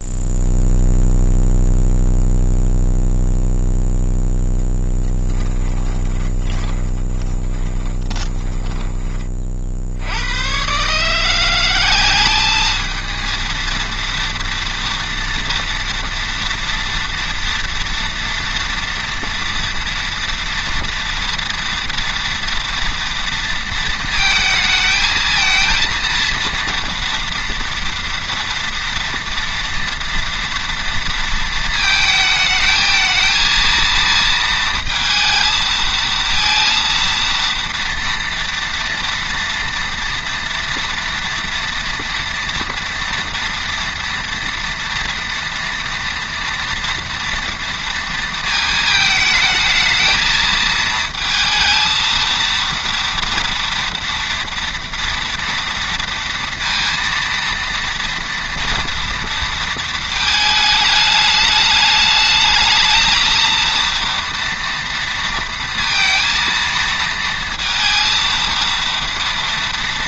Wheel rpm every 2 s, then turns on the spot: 0, 0, 10, 20, 20, 120, 210, 240, 230, 230, 230, 230, 220, 230, 230, 230, 220, 230, 230, 240, 230, 230, 230, 230, 220, 220, 230, 230, 230, 230, 220, 220, 230, 230, 230.
6-10